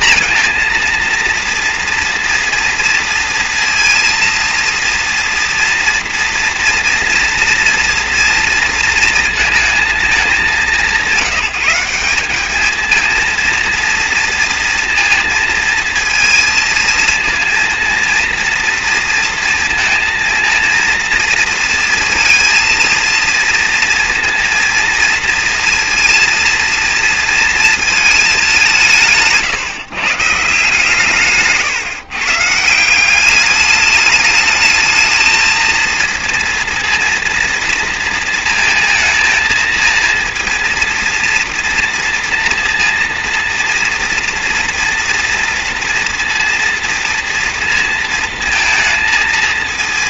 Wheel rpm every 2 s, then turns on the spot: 230, 240, 230, 240, 230, 210, 200, 230, 230, 230, 230, 230, 230, 230, 200, 140, 150, 210, 230, 230, 230, 230, 230, 230, 230.
none